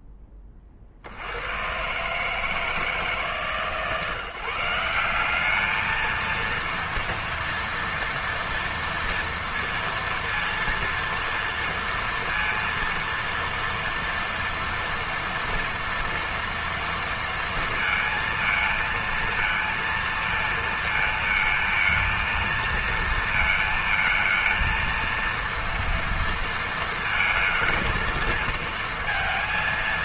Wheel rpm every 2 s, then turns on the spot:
70, 150, 190, 230, 230, 230, 230, 230, 230, 230, 230, 230, 230, 230, 230.
none